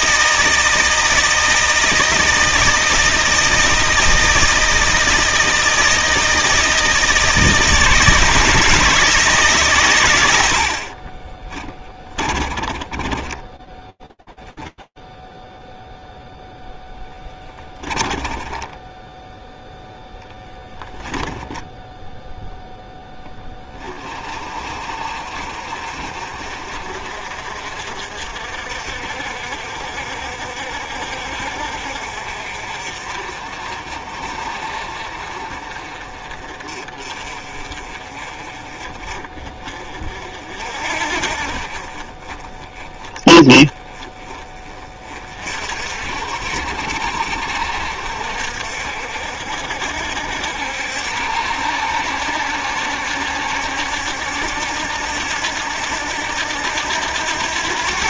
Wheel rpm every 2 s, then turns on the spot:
160, 160, 160, 160, 160, 70, 30, 0, 0, 20, 10, 10, 50, 50, 60, 50, 50, 40, 30, 30, 50, 20, 40, 60, 60, 70, 70, 70, 90.
12-14 18-22